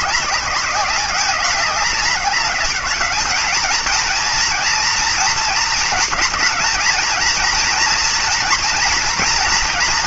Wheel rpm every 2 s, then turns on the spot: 200, 210, 230, 220, 240.
none